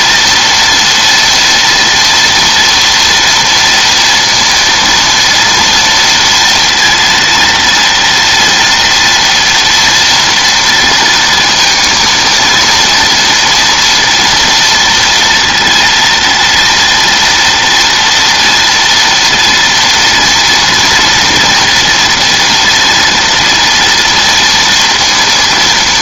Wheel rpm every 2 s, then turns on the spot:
230, 230, 230, 230, 240, 230, 230, 230, 230, 240, 230, 230, 230.
none